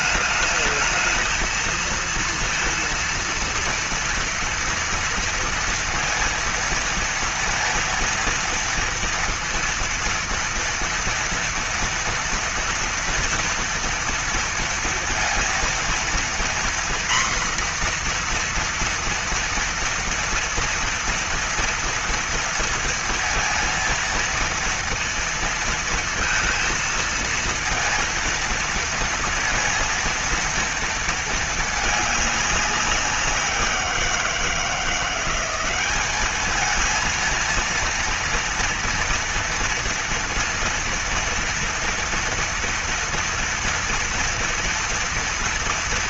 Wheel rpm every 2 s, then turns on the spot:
220, 230, 230, 230, 230, 230, 230, 230, 240, 240, 240, 230, 230, 230, 230, 230, 200, 170, 220, 230, 230, 230, 230.
none